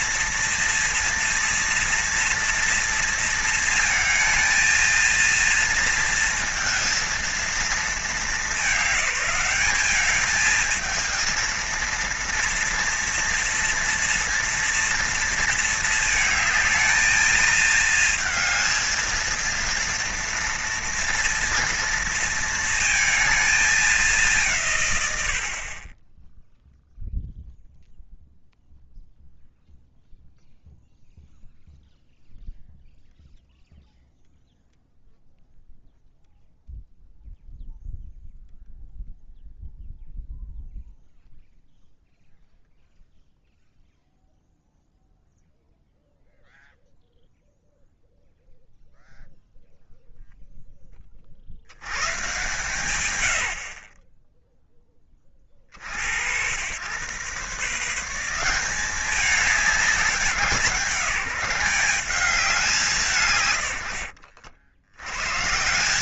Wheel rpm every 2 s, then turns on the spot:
230, 230, 220, 230, 200, 220, 230, 230, 220, 220, 230, 230, 140, 0, 0, 0, 0, 0, 0, 0, 0, 0, 0, 0, 0, 10, 110, 0, 100, 190, 190, 180, 90.
none